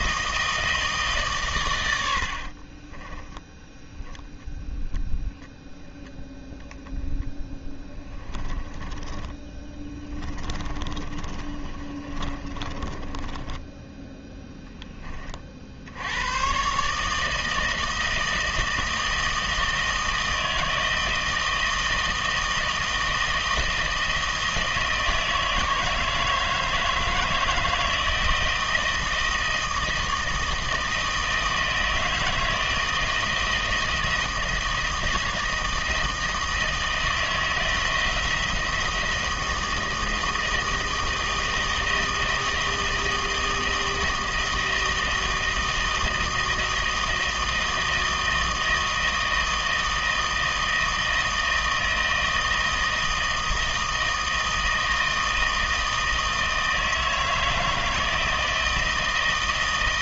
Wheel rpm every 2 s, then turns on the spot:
160, 40, 10, 0, 20, 30, 30, 20, 140, 160, 160, 160, 160, 160, 160, 160, 160, 160, 160, 160, 160, 160, 160, 160, 160, 160, 160, 160, 160, 160.
2-4 8-14